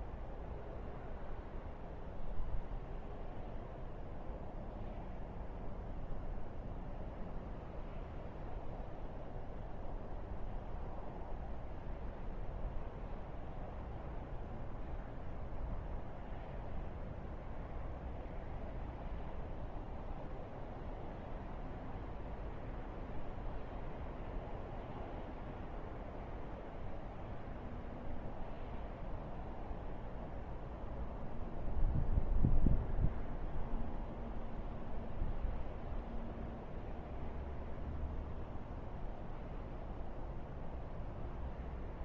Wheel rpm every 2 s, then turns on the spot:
0, 0, 0, 0, 0, 0, 0, 0, 0, 0, 0, 0, 0, 0, 0, 0, 0, 0, 0, 0, 0.
none